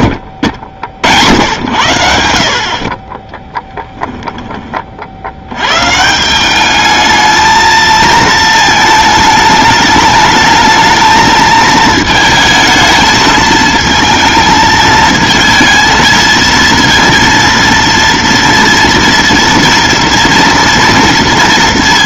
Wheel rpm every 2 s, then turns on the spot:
80, 60, 20, 200, 220, 220, 220, 220, 230, 230, 240.
none